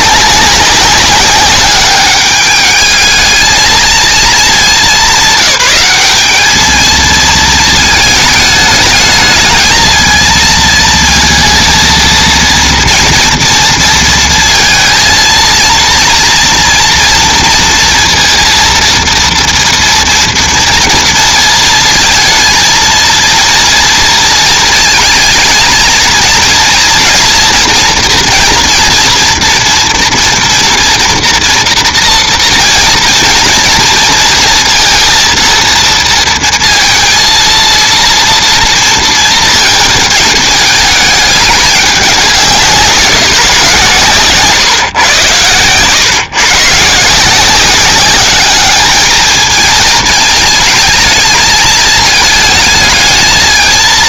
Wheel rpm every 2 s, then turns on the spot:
200, 210, 220, 210, 210, 220, 230, 230, 230, 230, 230, 230, 230, 230, 230, 230, 230, 230, 230, 230, 210, 170, 140, 150, 210, 220, 220.
44-46